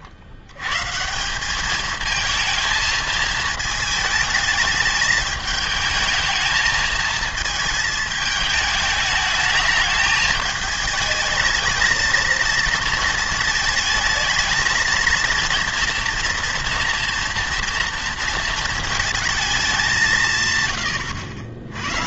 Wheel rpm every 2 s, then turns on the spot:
100, 230, 210, 220, 210, 220, 230, 220, 230, 220, 130.
none